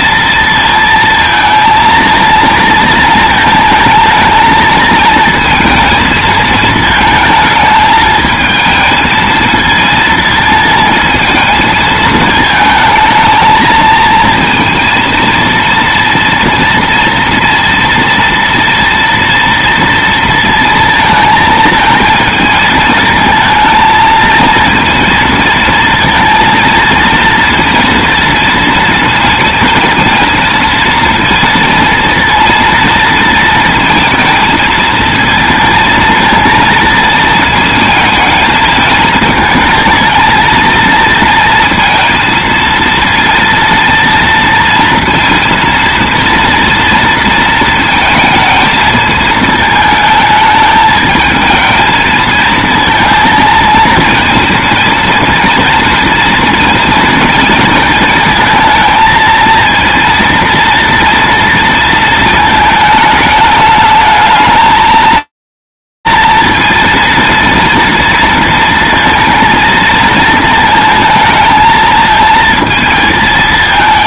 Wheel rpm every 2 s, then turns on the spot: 230, 220, 230, 220, 220, 220, 220, 230, 240, 230, 230, 220, 230, 230, 230, 230, 230, 230, 230, 220, 230, 230, 230, 230, 220, 220, 220, 230, 230, 220, 230, 220, 220, 230, 230, 220, 220.
none